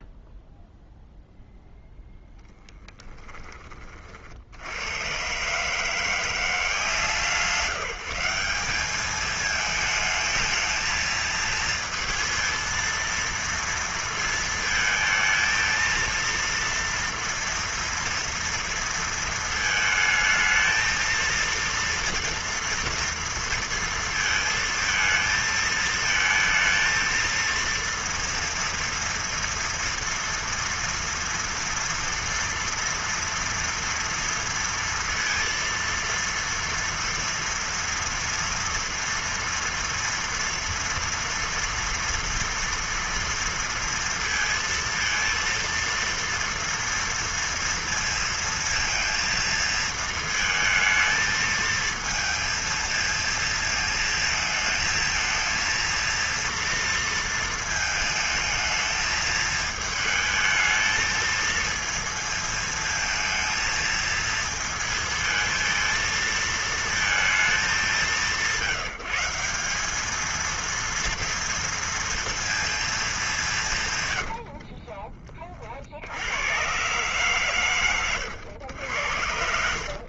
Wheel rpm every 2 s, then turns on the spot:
0, 10, 80, 170, 200, 220, 230, 220, 230, 230, 220, 230, 220, 230, 230, 230, 230, 230, 230, 230, 230, 230, 230, 230, 230, 220, 230, 220, 230, 220, 220, 220, 220, 220, 180, 230, 230, 70, 100, 100.
2-4 74-76